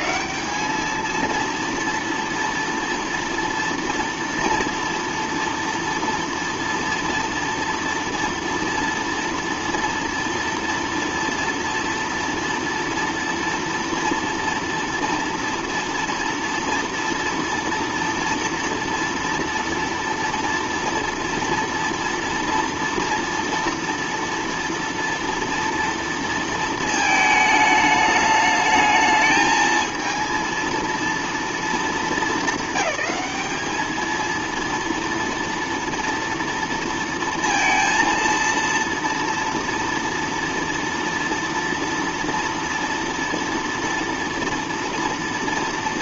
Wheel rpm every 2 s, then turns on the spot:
220, 230, 230, 230, 230, 230, 230, 230, 230, 230, 230, 230, 230, 220, 210, 230, 210, 230, 230, 230, 230, 230, 230.
none